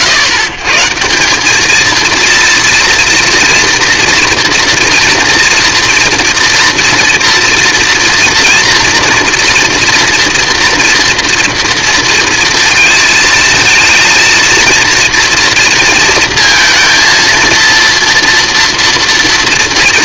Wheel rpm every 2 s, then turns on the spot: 150, 230, 230, 230, 230, 230, 230, 230, 230, 230.
none